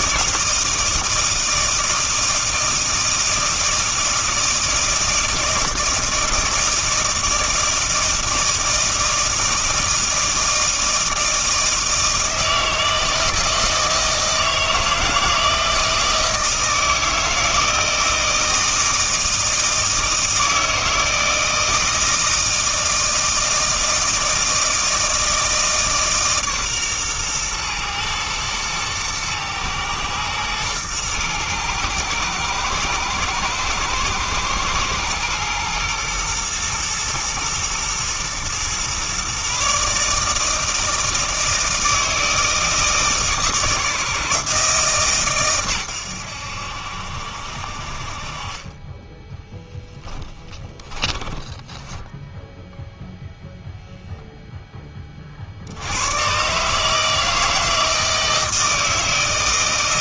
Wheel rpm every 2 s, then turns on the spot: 160, 160, 160, 160, 160, 160, 160, 160, 160, 160, 160, 160, 160, 130, 120, 110, 110, 110, 120, 120, 160, 160, 150, 70, 30, 20, 0, 10, 150, 160.
50-52